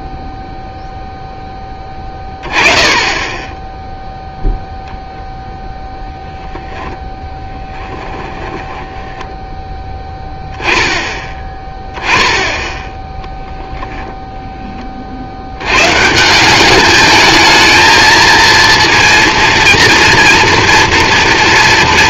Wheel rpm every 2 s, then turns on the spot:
0, 30, 0, 10, 10, 10, 10, 20, 190, 230, 230.
8-10